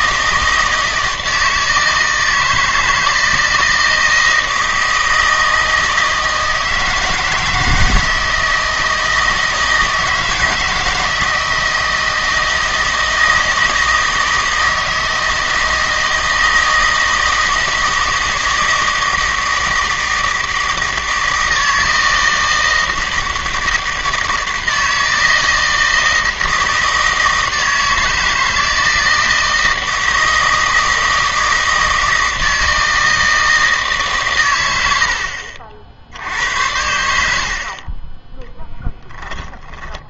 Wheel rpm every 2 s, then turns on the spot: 160, 160, 160, 160, 160, 160, 160, 160, 160, 160, 160, 160, 160, 160, 160, 160, 160, 100, 80, 10.
none